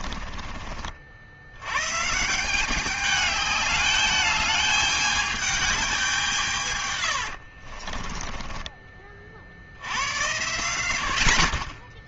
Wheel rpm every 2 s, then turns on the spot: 40, 170, 210, 150, 20, 80.
8-10